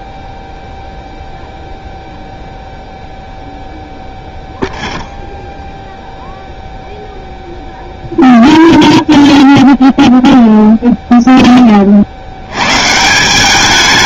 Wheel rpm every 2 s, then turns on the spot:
0, 0, 0, 0, 0, 0, 110.
none